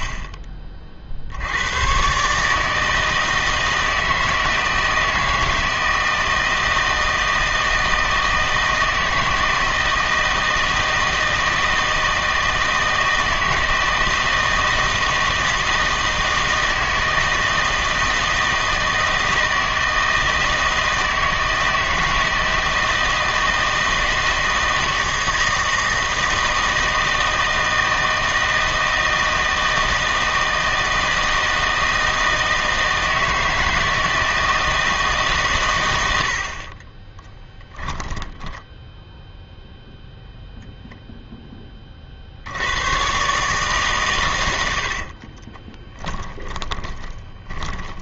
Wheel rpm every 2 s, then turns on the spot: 40, 160, 160, 160, 160, 160, 160, 160, 160, 160, 160, 160, 160, 160, 160, 160, 160, 160, 30, 10, 0, 110, 60, 20.
36-38 44-48